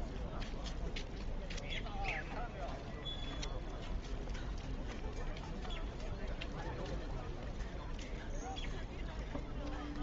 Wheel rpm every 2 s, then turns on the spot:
0, 0, 0, 0, 0.
none